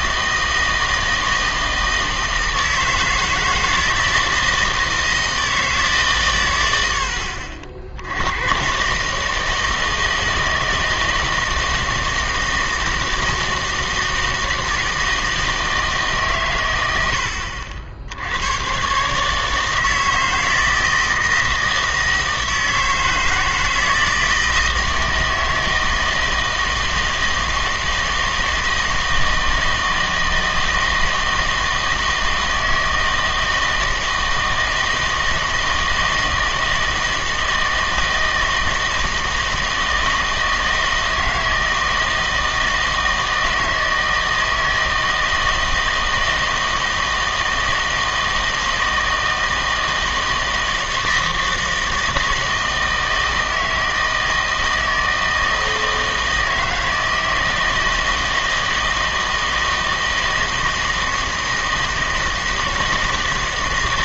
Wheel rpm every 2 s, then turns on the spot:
160, 160, 160, 100, 120, 160, 160, 160, 110, 110, 160, 160, 160, 160, 160, 160, 160, 160, 160, 160, 160, 160, 160, 160, 160, 160, 160, 160, 160, 160, 160, 160.
none